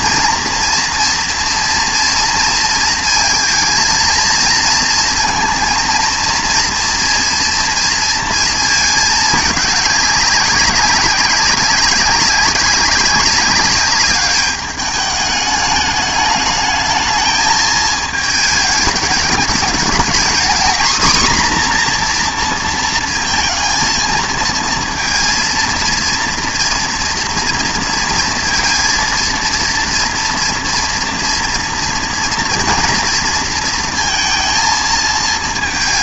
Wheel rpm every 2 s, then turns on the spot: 230, 230, 230, 230, 220, 200, 200, 210, 220, 220, 240, 230, 230, 230, 230, 230, 230, 220.
none